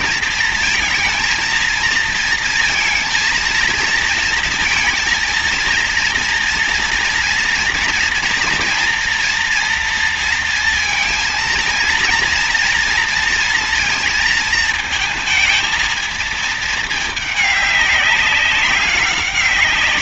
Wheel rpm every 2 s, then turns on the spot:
230, 230, 230, 230, 230, 230, 230, 220, 220, 190.
none